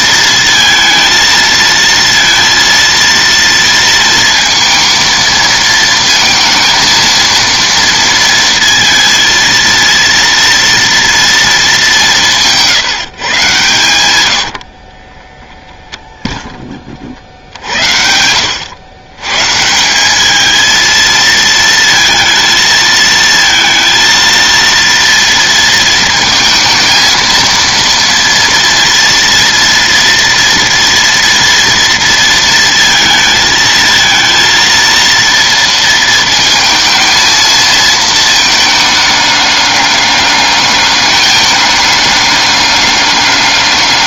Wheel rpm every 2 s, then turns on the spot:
230, 230, 230, 230, 230, 230, 170, 70, 20, 100, 220, 220, 230, 230, 230, 230, 230, 230, 230, 220, 210, 210.
14-16